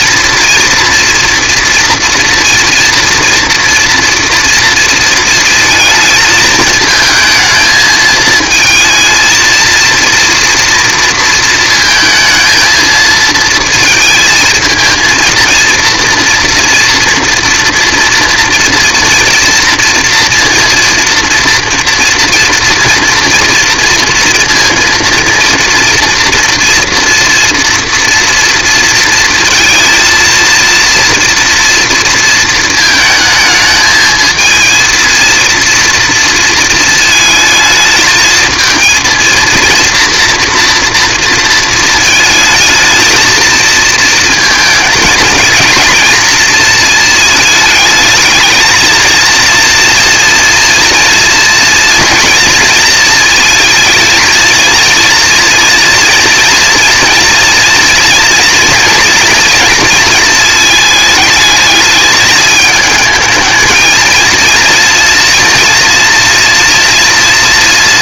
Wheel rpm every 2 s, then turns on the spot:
230, 240, 230, 220, 220, 230, 220, 220, 230, 230, 230, 230, 230, 230, 230, 230, 230, 220, 230, 230, 230, 220, 230, 230, 220, 230, 240, 220, 230, 230, 220, 220, 230, 230.
none